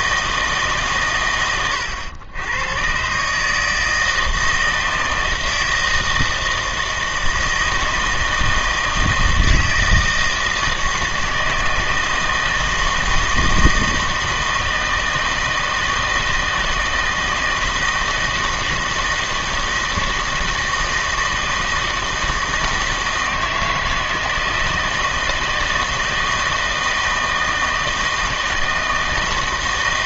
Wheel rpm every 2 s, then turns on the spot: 140, 120, 160, 160, 160, 160, 160, 160, 160, 160, 160, 160, 160, 160, 160.
none